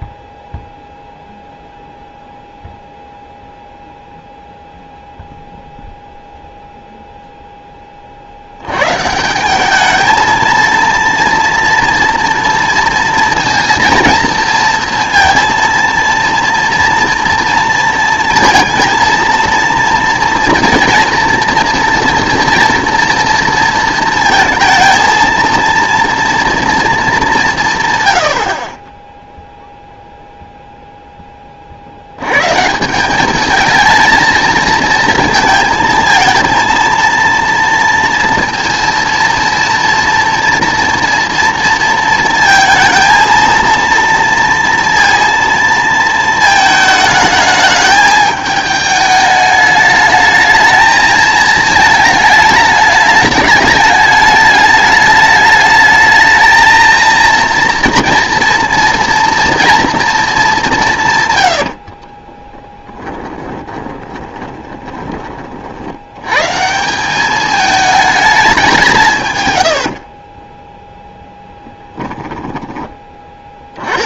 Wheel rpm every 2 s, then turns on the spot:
0, 0, 0, 0, 100, 230, 230, 230, 230, 230, 230, 230, 230, 230, 40, 0, 130, 230, 230, 230, 240, 230, 230, 220, 210, 220, 210, 210, 220, 230, 200, 10, 20, 160, 190, 20, 10.
62-66 70-74